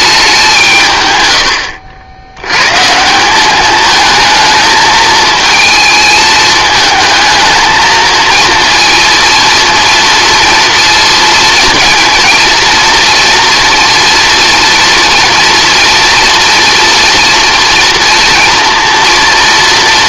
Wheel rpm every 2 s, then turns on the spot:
160, 130, 220, 220, 230, 230, 240, 240, 230, 230.
none